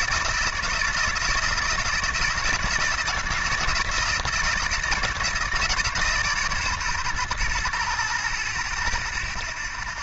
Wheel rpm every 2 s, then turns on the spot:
160, 160, 160, 130, 20.
none